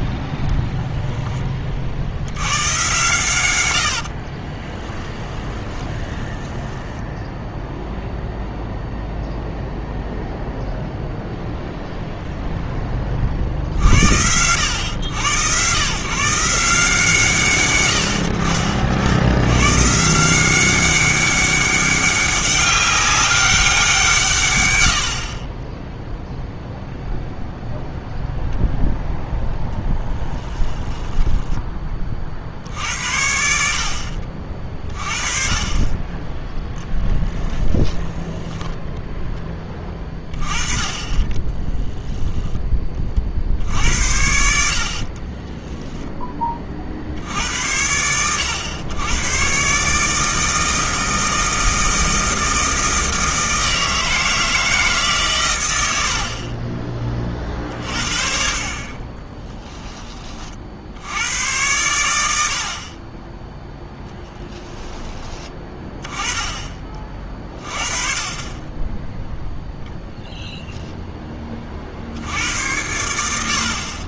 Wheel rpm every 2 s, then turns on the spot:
0, 110, 30, 10, 0, 0, 10, 100, 160, 60, 190, 200, 100, 0, 0, 10, 70, 40, 10, 10, 20, 20, 60, 40, 100, 160, 160, 160, 30, 40, 60, 50, 20, 30, 20, 0, 90.
4-8 30-32 38-40 64-66